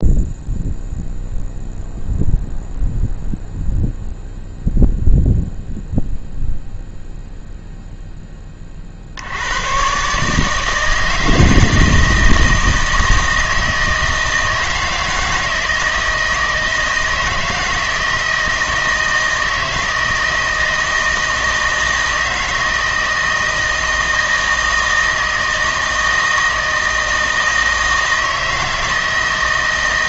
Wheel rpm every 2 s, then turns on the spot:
0, 0, 0, 0, 30, 160, 160, 160, 160, 160, 160, 160, 160, 160, 160.
none